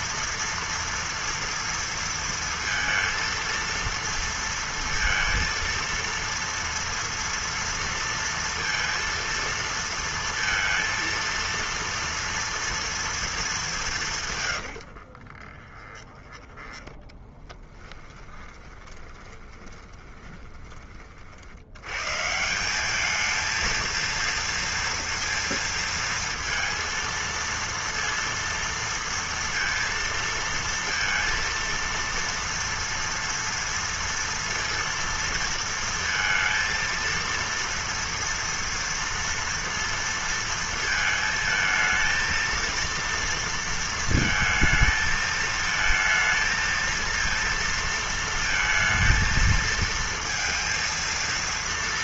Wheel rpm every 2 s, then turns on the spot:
230, 230, 230, 230, 230, 230, 230, 140, 20, 20, 20, 150, 230, 230, 230, 230, 230, 230, 230, 230, 230, 230, 230, 230, 230, 230.
14-22